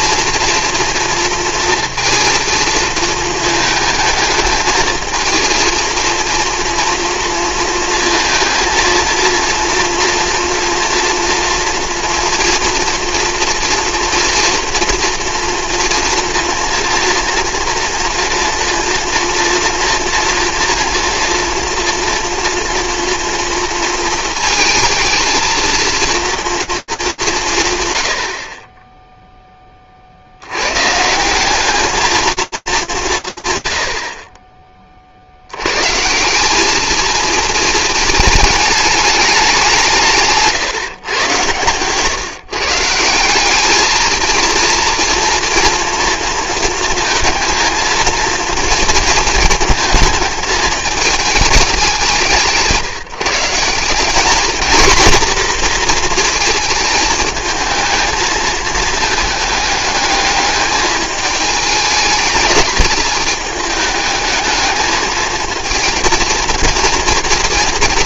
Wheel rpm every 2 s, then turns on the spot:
230, 230, 220, 230, 230, 230, 230, 240, 230, 240, 230, 230, 220, 220, 30, 120, 200, 40, 220, 210, 140, 160, 230, 230, 220, 210, 160, 230, 220, 220, 210, 210, 220, 230.
none